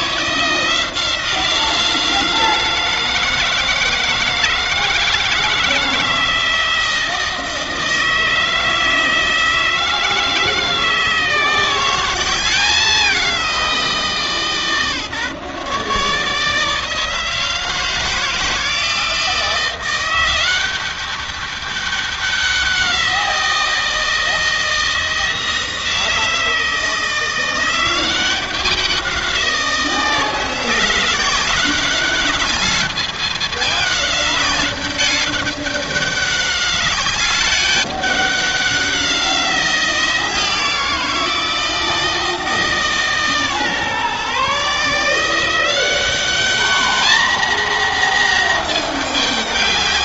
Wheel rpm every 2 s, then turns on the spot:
160, 160, 160, 160, 160, 160, 180, 160, 150, 160, 190, 190, 160, 160, 160, 170, 200, 200, 200, 200, 170, 160, 140, 200, 240.
none